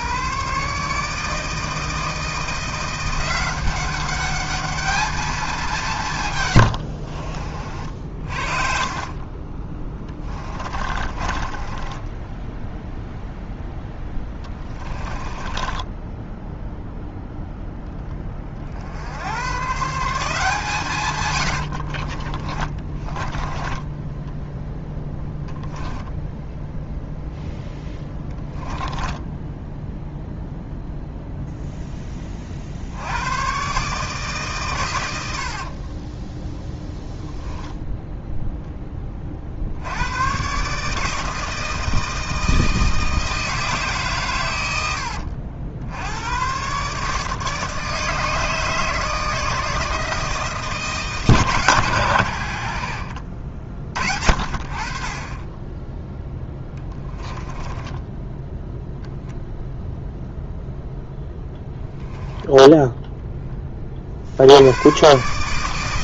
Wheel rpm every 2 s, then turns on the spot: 140, 170, 210, 100, 50, 30, 0, 20, 0, 50, 160, 30, 10, 0, 10, 0, 60, 120, 0, 10, 140, 160, 90, 120, 150, 150, 60, 50, 10, 0, 0, 10, 100.
6-12 14-16 22-24 28-30 56-58 62-64